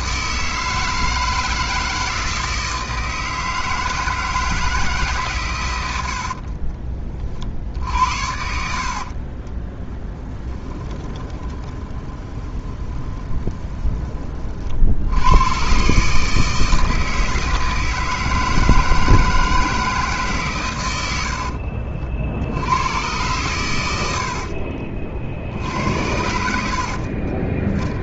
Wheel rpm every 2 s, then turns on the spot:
160, 160, 160, 40, 70, 20, 20, 50, 160, 160, 120, 90, 30, 70.
6-14 26-28